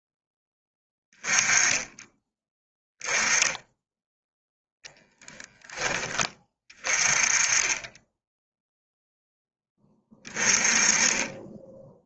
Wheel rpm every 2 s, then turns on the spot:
10, 10, 10, 30, 0, 20.
none